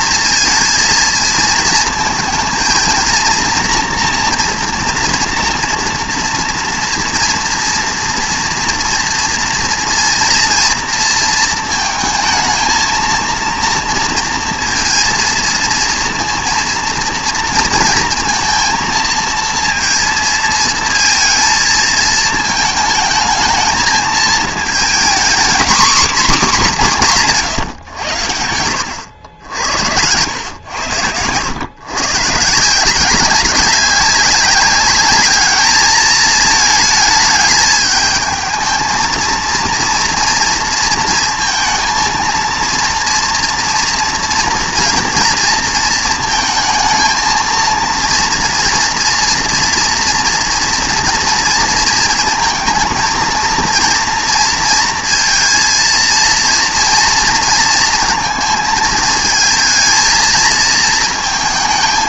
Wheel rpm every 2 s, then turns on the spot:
230, 220, 230, 230, 230, 230, 220, 230, 230, 230, 220, 220, 230, 220, 100, 100, 160, 200, 220, 220, 230, 230, 230, 230, 230, 240, 230, 230, 240, 220, 230.
none